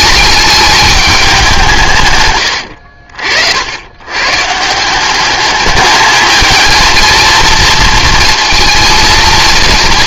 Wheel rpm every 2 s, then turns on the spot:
210, 70, 180, 230, 230.
2-4